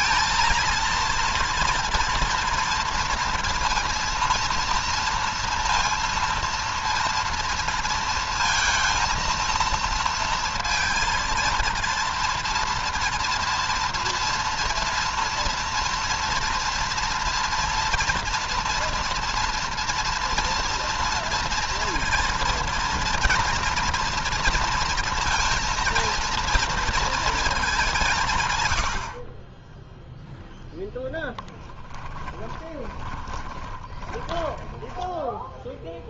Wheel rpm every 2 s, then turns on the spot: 230, 230, 230, 230, 230, 230, 230, 230, 230, 230, 230, 230, 230, 230, 80, 0, 20, 10.
32-34